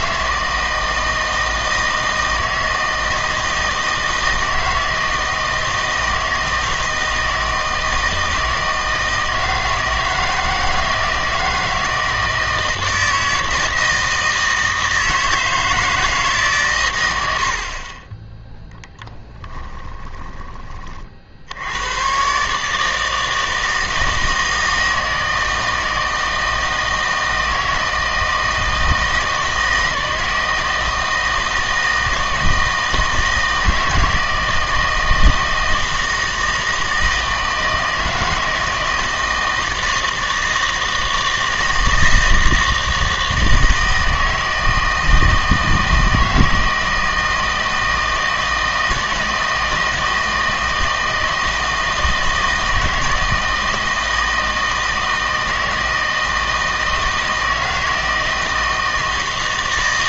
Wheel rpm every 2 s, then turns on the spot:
160, 160, 160, 160, 160, 160, 160, 160, 130, 10, 30, 150, 160, 160, 160, 160, 160, 160, 160, 160, 160, 160, 160, 160, 160, 160, 160, 160, 160, 160.
18-20